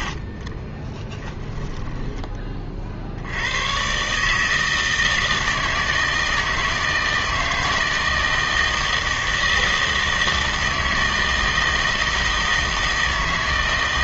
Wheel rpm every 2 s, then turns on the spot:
40, 30, 150, 160, 160, 160, 160.
0-2